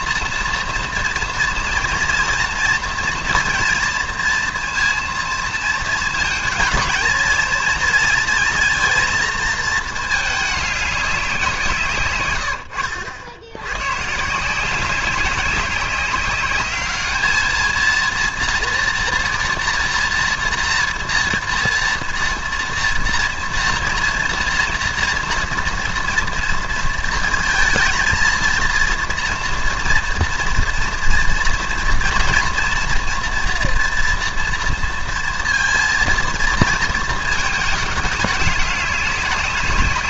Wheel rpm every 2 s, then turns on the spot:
230, 230, 230, 220, 230, 210, 100, 170, 200, 230, 240, 230, 230, 230, 230, 230, 230, 230, 230, 200.
none